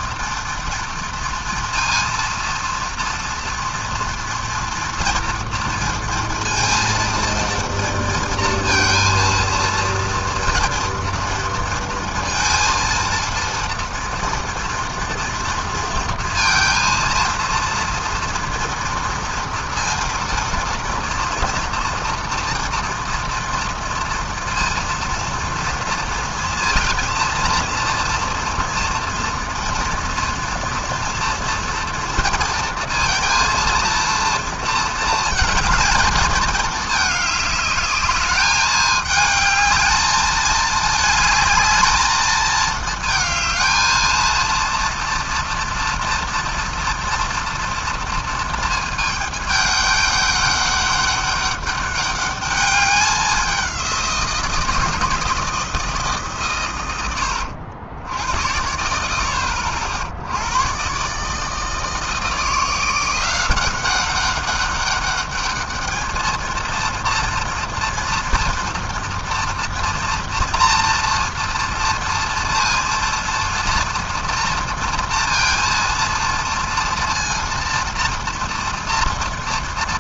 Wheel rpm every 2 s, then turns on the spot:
230, 230, 230, 230, 230, 230, 230, 230, 230, 230, 230, 240, 230, 230, 240, 230, 230, 230, 210, 210, 220, 220, 230, 230, 220, 200, 200, 170, 120, 80, 120, 170, 200, 230, 240, 230, 230, 230, 230, 230.
none